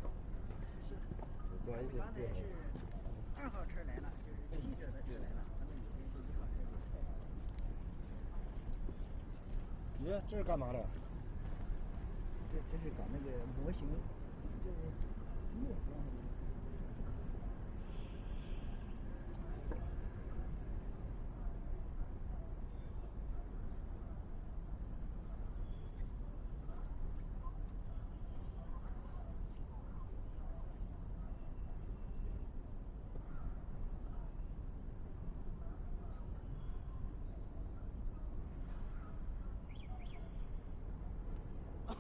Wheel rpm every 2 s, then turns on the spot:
0, 0, 0, 0, 0, 0, 0, 0, 0, 0, 0, 0, 0, 0, 0, 0, 0, 0, 0, 0, 0.
none